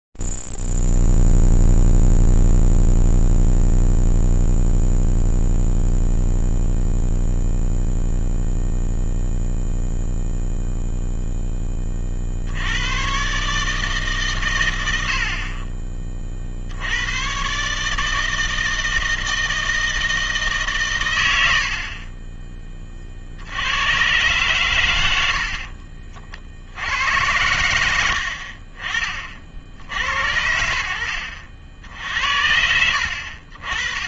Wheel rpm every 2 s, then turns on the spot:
0, 0, 0, 0, 0, 0, 60, 130, 50, 160, 160, 20, 120, 60, 60, 70, 70.
none